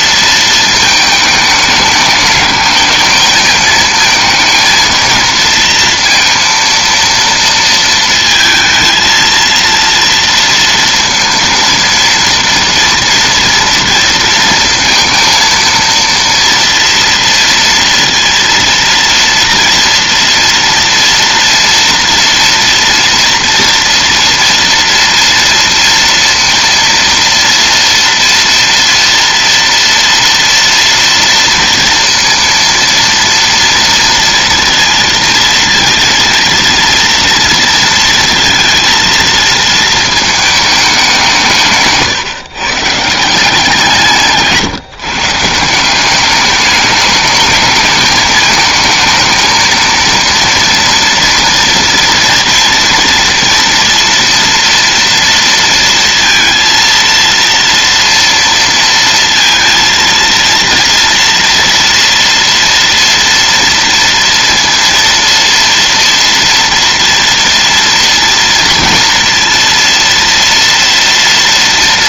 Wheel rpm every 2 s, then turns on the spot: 220, 210, 230, 230, 230, 230, 230, 230, 230, 230, 230, 230, 230, 230, 230, 230, 230, 230, 230, 230, 200, 150, 140, 210, 220, 230, 230, 230, 230, 230, 230, 230, 230, 230, 230, 230.
none